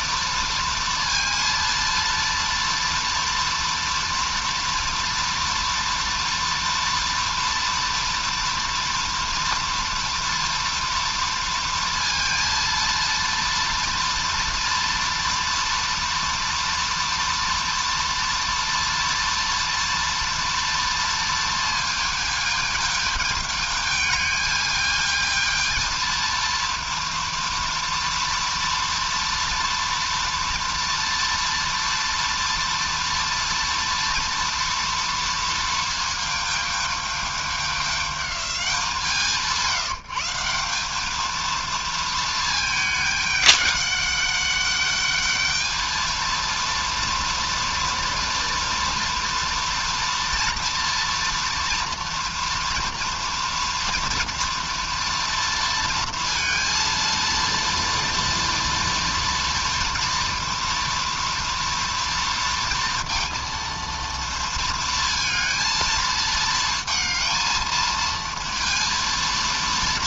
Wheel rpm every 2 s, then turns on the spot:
230, 230, 230, 230, 230, 230, 230, 230, 230, 230, 230, 220, 210, 230, 230, 230, 230, 230, 220, 200, 180, 220, 200, 230, 230, 230, 230, 230, 230, 230, 230, 230, 230, 220, 230.
none